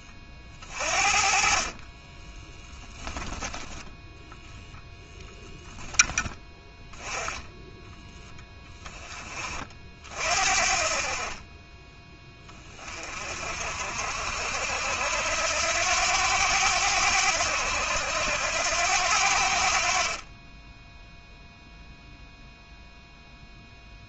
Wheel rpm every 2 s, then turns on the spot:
40, 10, 0, 10, 20, 40, 40, 80, 90, 80, 0, 0.
none